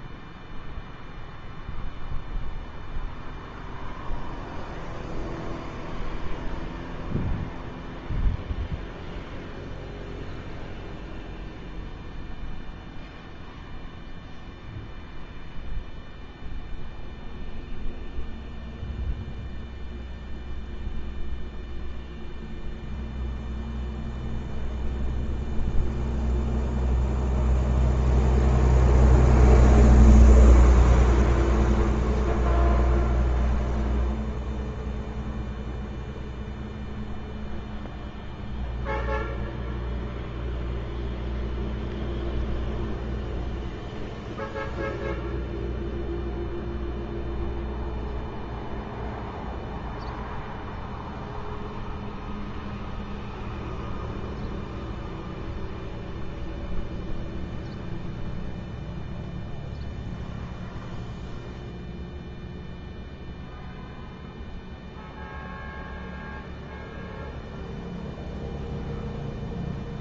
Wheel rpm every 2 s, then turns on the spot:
0, 0, 0, 0, 0, 0, 0, 0, 0, 0, 0, 0, 0, 0, 0, 0, 0, 0, 0, 0, 0, 0, 0, 0, 0, 0, 0, 0, 0, 0, 0, 0, 0, 0, 0.
none